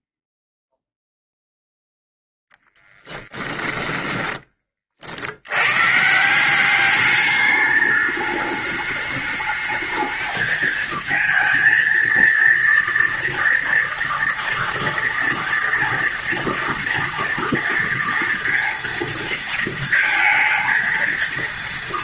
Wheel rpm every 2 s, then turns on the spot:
0, 0, 20, 180, 210, 220, 230, 240, 230, 230, 230.
none